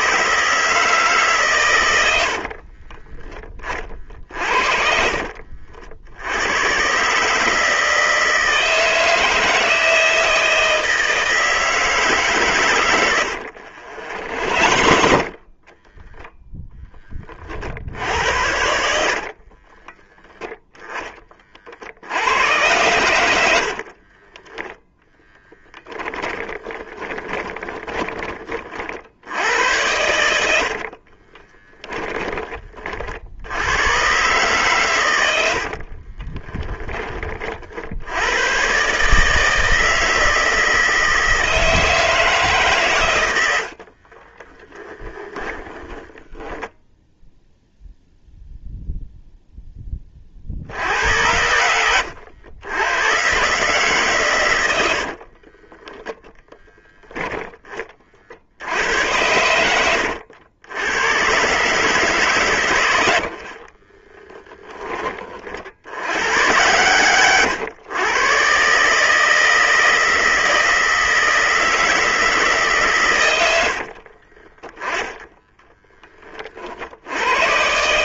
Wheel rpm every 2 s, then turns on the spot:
140, 20, 60, 150, 160, 160, 90, 40, 20, 50, 20, 90, 10, 20, 70, 40, 50, 110, 30, 150, 160, 110, 10, 0, 0, 80, 120, 50, 10, 90, 120, 60, 30, 120, 160, 160, 100, 30, 80.
12-16 18-20 26-28 30-32 34-36 44-46 54-56 62-64 74-76